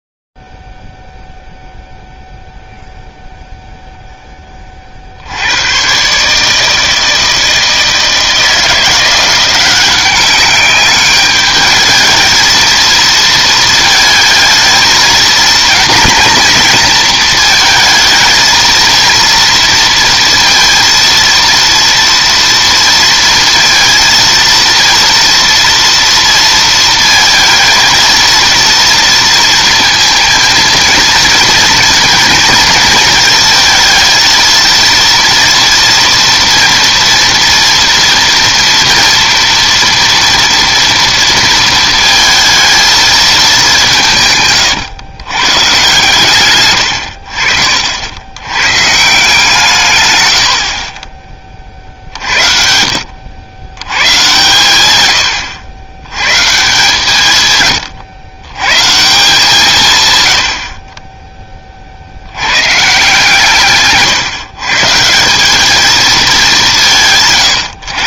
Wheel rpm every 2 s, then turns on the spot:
0, 0, 0, 120, 160, 190, 220, 220, 230, 220, 230, 230, 230, 230, 230, 230, 230, 230, 230, 230, 230, 220, 170, 140, 80, 120, 60, 120, 120, 120, 100, 100, 140, 210.
none